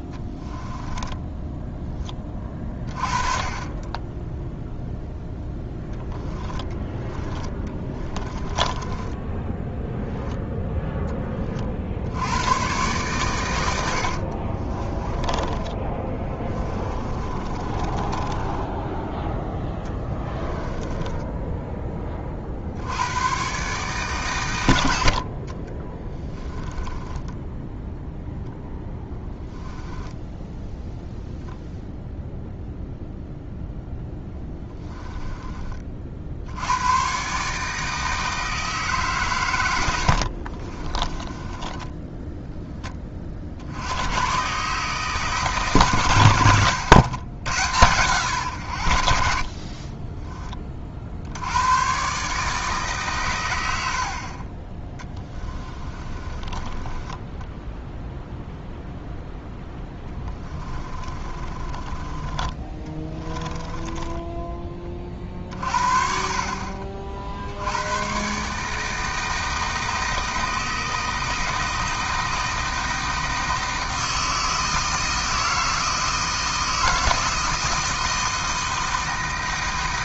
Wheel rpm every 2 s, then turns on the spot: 10, 40, 0, 10, 20, 0, 120, 30, 20, 20, 20, 70, 90, 10, 10, 10, 0, 10, 90, 150, 30, 10, 140, 110, 100, 30, 150, 20, 20, 0, 20, 20, 20, 50, 160, 160, 160, 160, 160, 160.
0-2 6-10 14-22 26-28 34-36 40-42 46-48 54-58 60-64